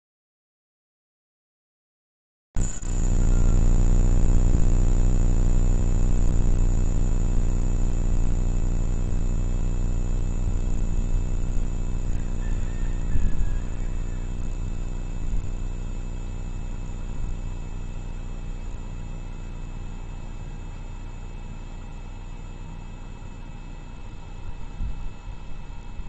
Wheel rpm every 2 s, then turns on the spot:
0, 0, 0, 0, 0, 0, 0, 0, 0, 0, 0, 0, 0.
none